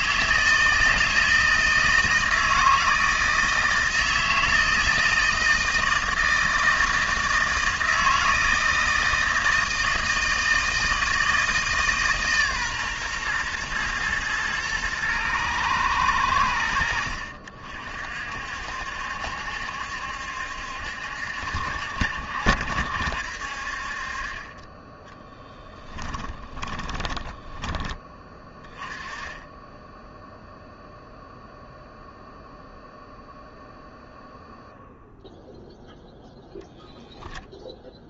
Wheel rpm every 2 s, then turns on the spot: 160, 160, 160, 160, 160, 160, 130, 110, 50, 70, 70, 70, 20, 20, 20, 0, 0, 0, 0.
24-28